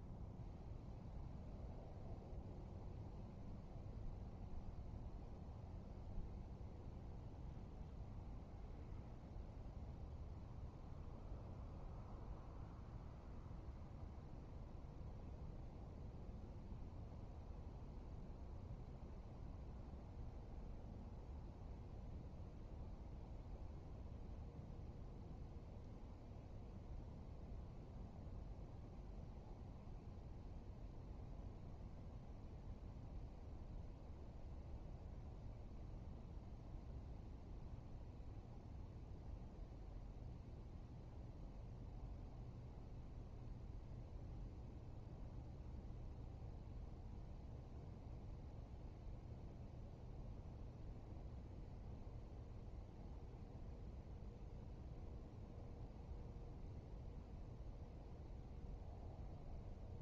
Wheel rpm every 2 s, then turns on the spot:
0, 0, 0, 0, 0, 0, 0, 0, 0, 0, 0, 0, 0, 0, 0, 0, 0, 0, 0, 0, 0, 0, 0, 0, 0, 0, 0, 0, 0, 0.
none